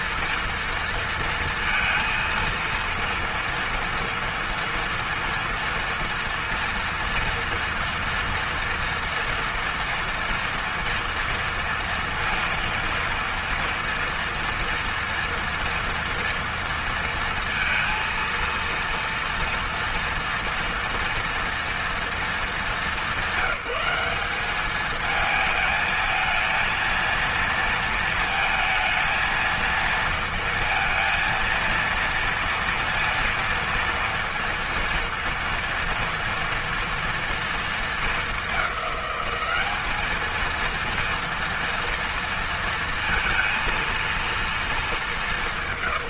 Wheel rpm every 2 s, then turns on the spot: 230, 230, 230, 230, 230, 230, 230, 240, 230, 230, 230, 200, 210, 230, 220, 230, 230, 230, 230, 200, 230, 230, 220.
none